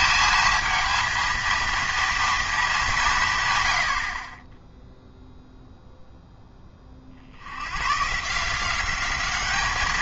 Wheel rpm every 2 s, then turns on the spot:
220, 190, 0, 30, 190.
none